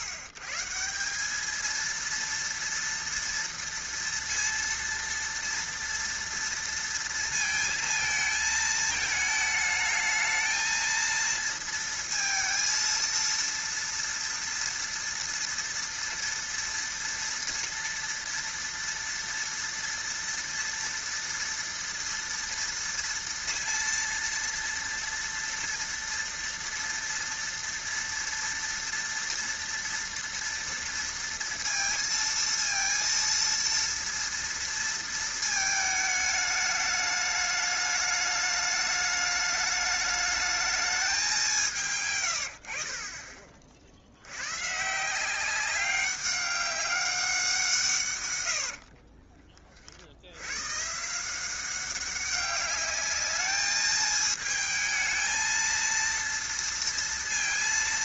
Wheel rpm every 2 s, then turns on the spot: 130, 230, 230, 230, 220, 220, 230, 230, 230, 230, 230, 230, 230, 230, 230, 230, 230, 230, 210, 210, 210, 90, 110, 200, 90, 110, 200, 220, 230.
48-50